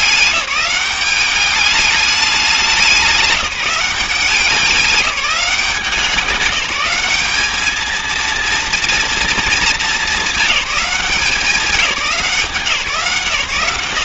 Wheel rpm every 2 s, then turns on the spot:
200, 190, 190, 200, 230, 210, 170.
none